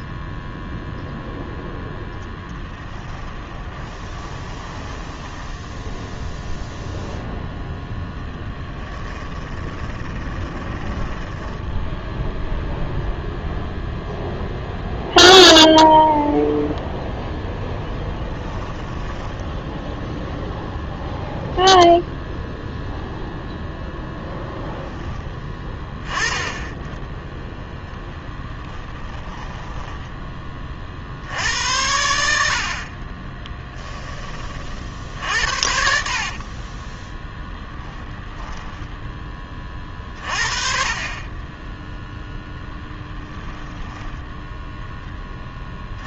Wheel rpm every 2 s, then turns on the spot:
0, 10, 20, 0, 10, 20, 0, 0, 0, 10, 0, 0, 0, 20, 20, 30, 60, 40, 30, 0, 40, 0, 0.
2-6 8-12 18-20 28-30 36-38